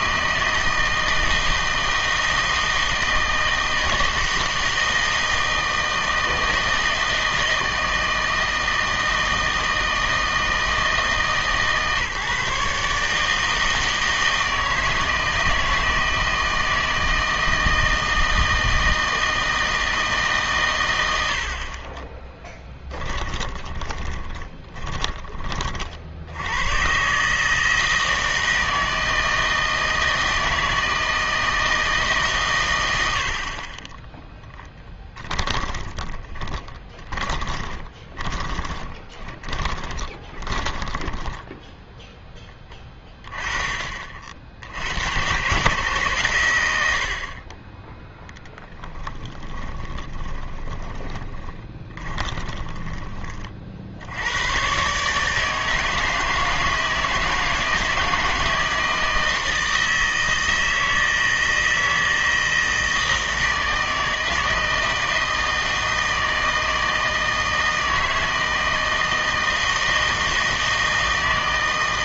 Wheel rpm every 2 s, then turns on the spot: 160, 160, 160, 160, 160, 160, 140, 160, 160, 160, 120, 10, 20, 110, 160, 160, 110, 10, 20, 20, 20, 10, 60, 90, 10, 10, 20, 130, 160, 160, 160, 160, 160, 160, 160, 160.
22-26 34-42 48-54